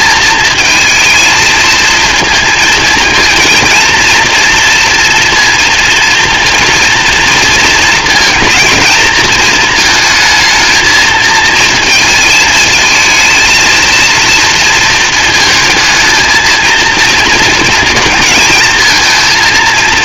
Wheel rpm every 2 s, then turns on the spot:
220, 220, 230, 230, 220, 230, 220, 230, 230, 220.
none